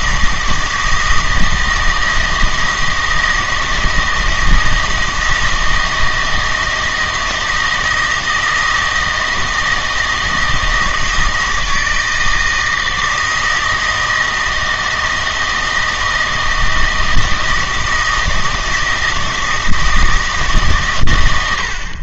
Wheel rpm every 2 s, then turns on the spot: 160, 160, 160, 160, 160, 160, 160, 160, 160, 160, 130.
none